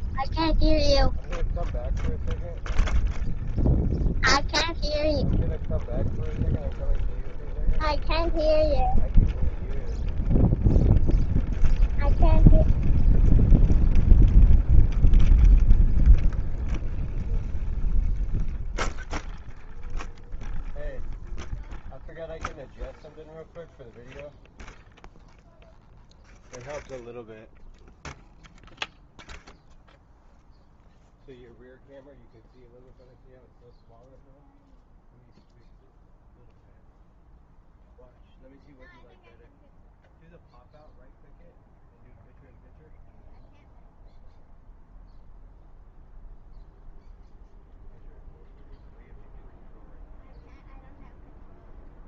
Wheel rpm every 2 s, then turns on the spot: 0, 0, 0, 0, 0, 0, 0, 0, 0, 0, 0, 0, 0, 0, 0, 0, 0, 0, 0, 0, 0, 0, 0, 0, 0, 0.
none